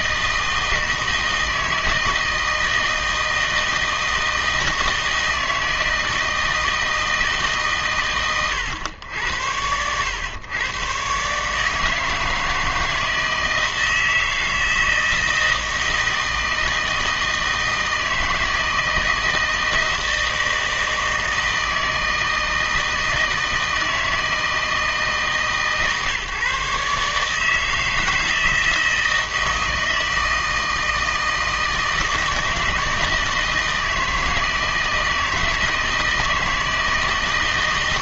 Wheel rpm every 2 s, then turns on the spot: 160, 160, 160, 160, 100, 120, 160, 160, 160, 160, 160, 160, 160, 140, 160, 160, 160, 160, 160.
none